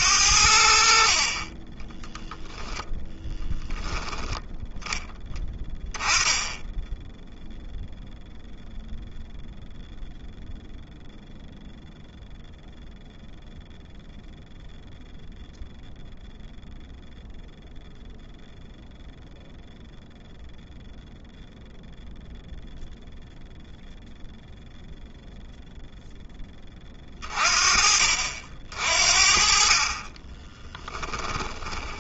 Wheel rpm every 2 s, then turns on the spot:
60, 10, 10, 10, 0, 0, 0, 0, 0, 0, 0, 0, 0, 30, 50, 10.
30-32